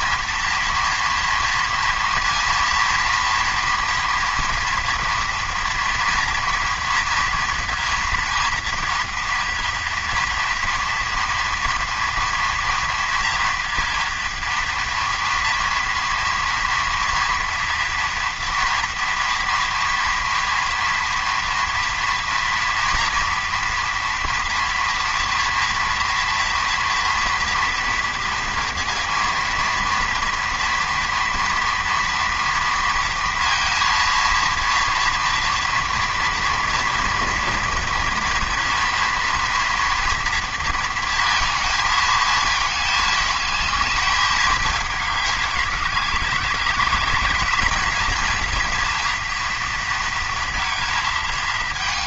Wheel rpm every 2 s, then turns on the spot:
240, 230, 230, 230, 230, 230, 240, 230, 230, 230, 230, 230, 230, 230, 230, 240, 230, 240, 230, 230, 230, 220, 210, 200, 230, 230.
none